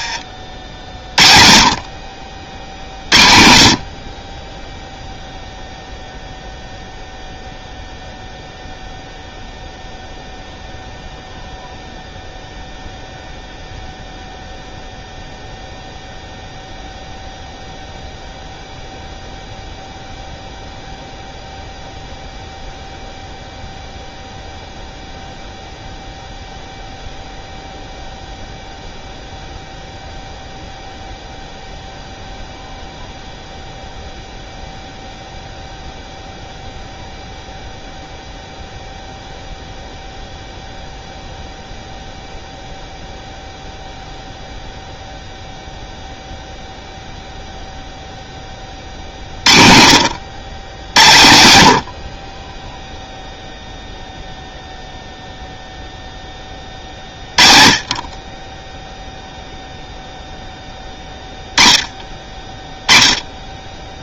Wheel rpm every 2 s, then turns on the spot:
50, 70, 10, 0, 0, 0, 0, 0, 0, 0, 0, 0, 0, 0, 0, 0, 0, 0, 0, 0, 0, 0, 0, 0, 30, 90, 0, 0, 30, 10, 10, 10.
none